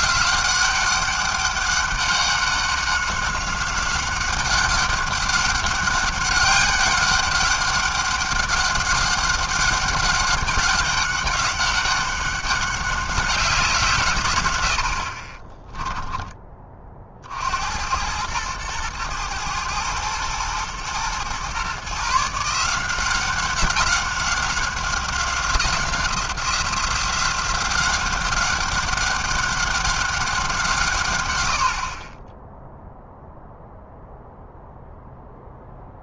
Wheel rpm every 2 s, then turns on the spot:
190, 190, 200, 200, 200, 200, 190, 90, 20, 110, 110, 160, 190, 180, 190, 180, 10, 0.
none